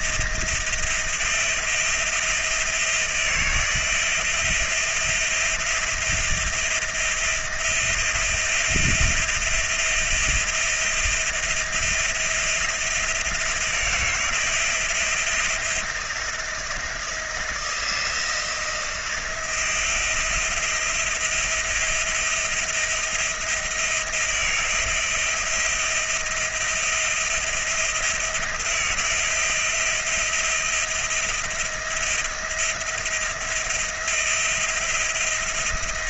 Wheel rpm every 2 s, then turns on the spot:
170, 170, 170, 170, 170, 170, 170, 170, 170, 170, 170, 170, 170, 170, 170, 170, 170, 170.
none